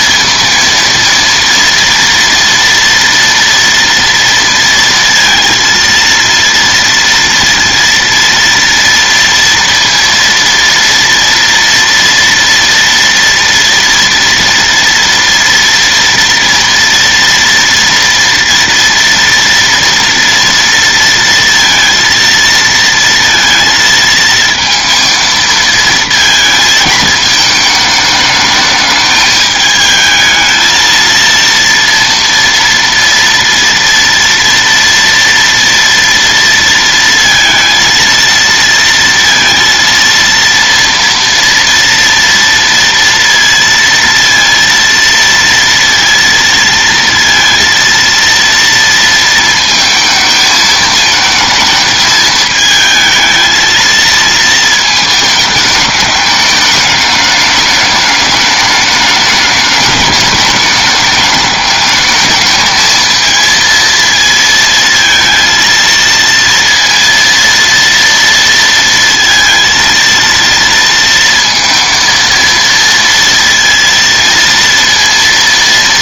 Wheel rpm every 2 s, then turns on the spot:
230, 230, 230, 230, 230, 230, 230, 230, 230, 230, 230, 230, 220, 220, 210, 220, 230, 230, 230, 230, 230, 230, 230, 230, 230, 220, 220, 220, 210, 210, 210, 220, 230, 230, 230, 230, 230, 230.
none